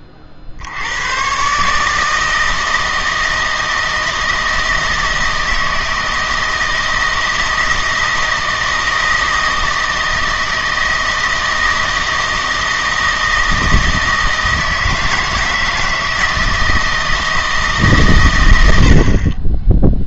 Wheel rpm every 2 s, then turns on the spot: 70, 160, 160, 160, 160, 160, 160, 160, 160, 70.
none